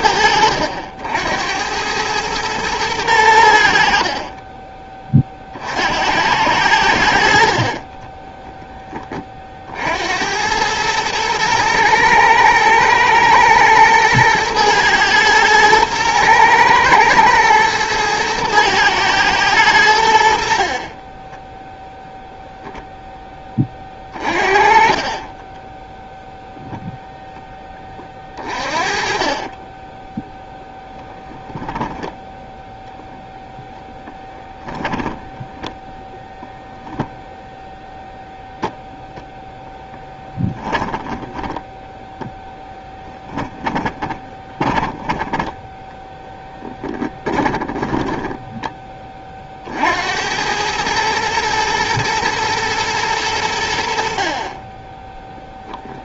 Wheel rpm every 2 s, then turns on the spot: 80, 110, 20, 90, 20, 110, 110, 110, 110, 110, 50, 0, 30, 0, 40, 0, 0, 10, 0, 0, 20, 10, 10, 20, 10, 110, 110, 20.
20-22 28-30 34-36 40-48